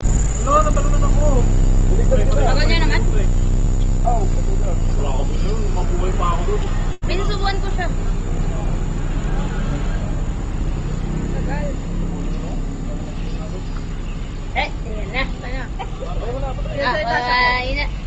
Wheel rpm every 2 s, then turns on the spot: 0, 0, 0, 0, 0, 0, 0, 0, 0.
none